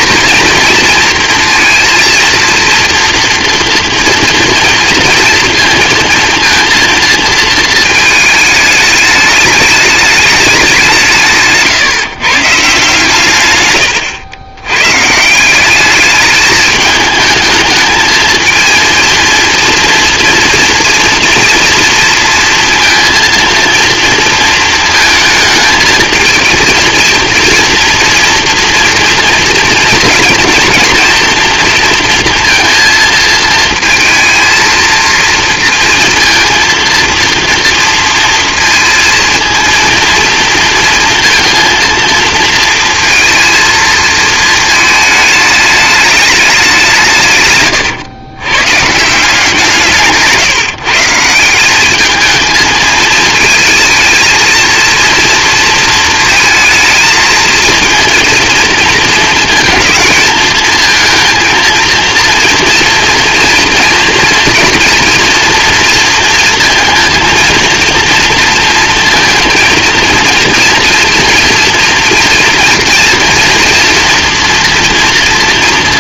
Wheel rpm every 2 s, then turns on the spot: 230, 230, 230, 230, 220, 190, 140, 110, 210, 220, 230, 230, 230, 230, 230, 230, 230, 220, 230, 230, 230, 230, 220, 190, 130, 160, 220, 230, 220, 230, 220, 230, 230, 230, 230, 230, 230, 240.
none